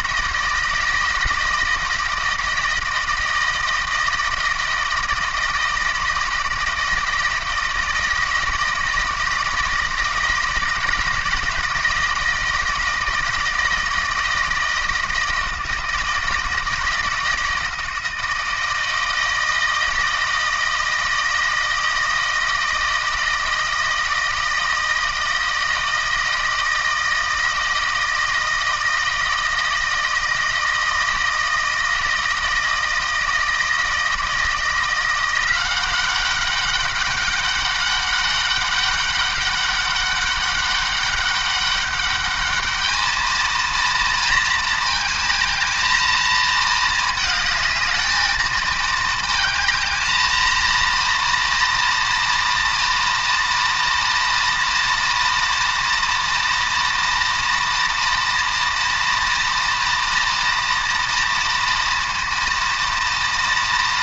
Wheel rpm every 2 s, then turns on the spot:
160, 160, 160, 160, 160, 160, 160, 160, 160, 160, 160, 160, 160, 160, 160, 160, 160, 170, 200, 200, 200, 210, 230, 220, 220, 230, 230, 230, 230, 230, 230, 230.
none